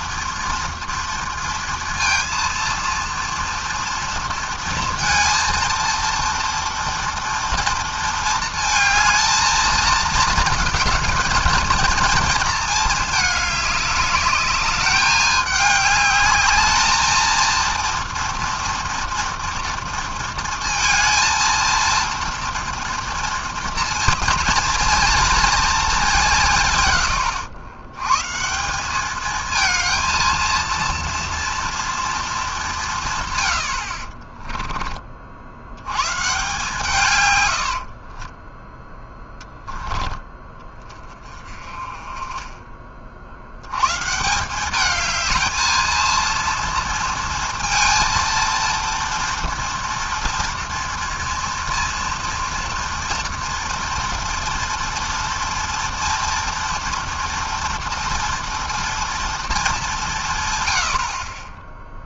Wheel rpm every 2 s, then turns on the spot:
230, 230, 230, 230, 220, 220, 210, 200, 230, 230, 230, 230, 230, 100, 220, 230, 110, 50, 110, 10, 30, 60, 220, 230, 240, 230, 230, 240, 230, 230, 30.
none